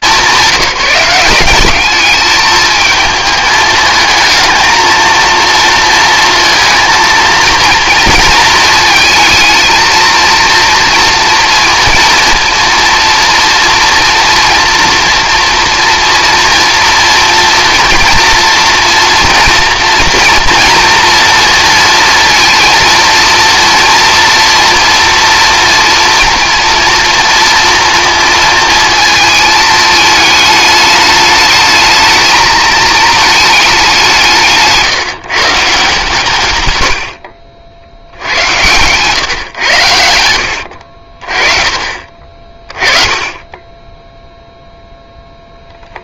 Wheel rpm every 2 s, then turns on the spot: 190, 220, 220, 230, 230, 230, 230, 230, 240, 230, 230, 230, 230, 230, 230, 210, 220, 140, 100, 110, 70, 20, 0.
36-38 40-42